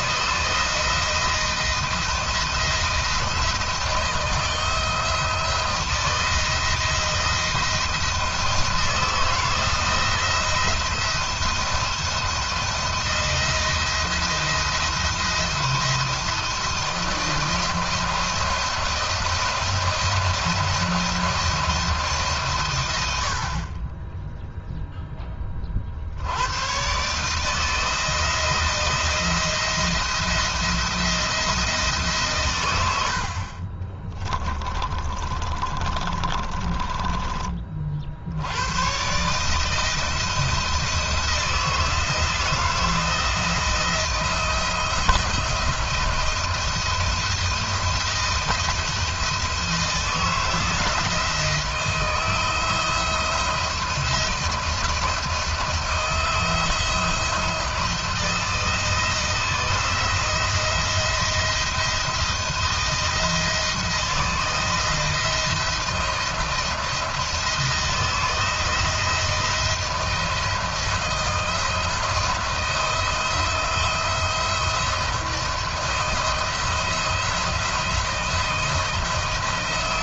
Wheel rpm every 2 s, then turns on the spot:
160, 170, 160, 160, 170, 170, 170, 170, 170, 170, 170, 130, 0, 110, 160, 170, 110, 20, 20, 90, 170, 170, 170, 170, 170, 160, 160, 170, 160, 160, 170, 170, 170, 170, 160, 170, 170, 170, 170, 170.
32-38